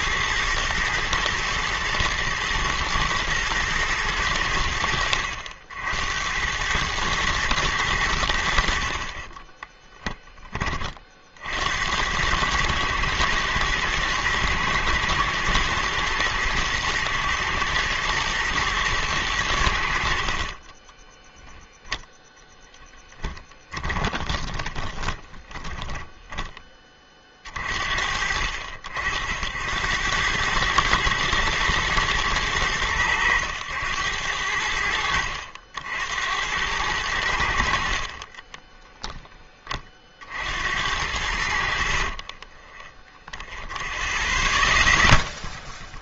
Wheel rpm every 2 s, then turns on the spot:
110, 120, 70, 110, 50, 40, 110, 110, 110, 110, 30, 10, 20, 30, 70, 110, 100, 70, 100, 10, 70, 10, 0.
20-26 38-40 42-44